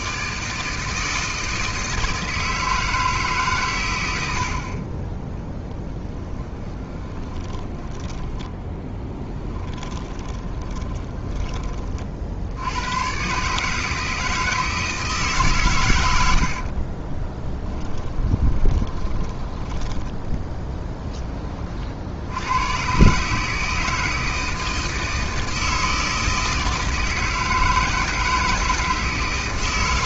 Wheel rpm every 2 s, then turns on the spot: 160, 160, 40, 20, 10, 20, 100, 160, 40, 20, 20, 120, 160, 160, 160.
6-12 16-22